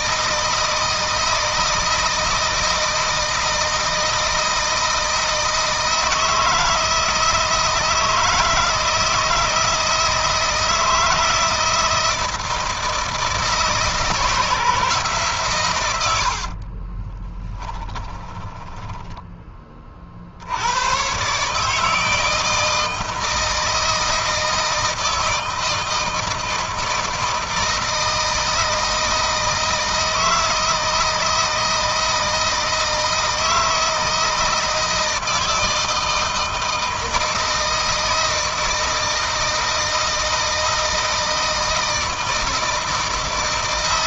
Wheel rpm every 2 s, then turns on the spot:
160, 160, 160, 160, 160, 160, 160, 150, 30, 20, 100, 160, 160, 160, 160, 160, 160, 160, 160, 160, 160, 160.
16-20